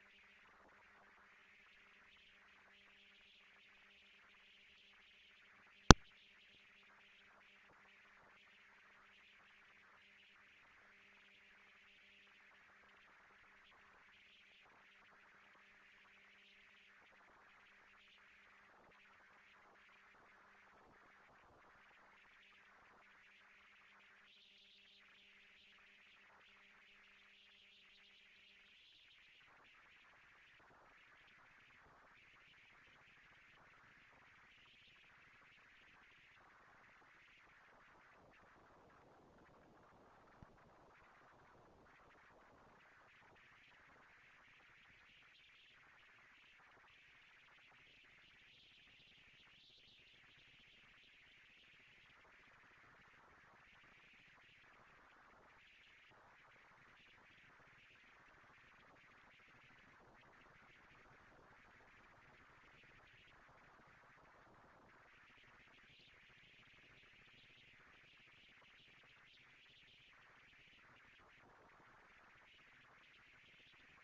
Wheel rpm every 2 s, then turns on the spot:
230, 240, 230, 230, 230, 220, 230, 230, 230, 230, 230, 230, 170, 160, 170, 220, 220, 230, 230, 230, 230, 220, 230, 230, 230, 230, 240, 230, 220, 210, 160, 160, 130, 220, 230, 230, 230.
none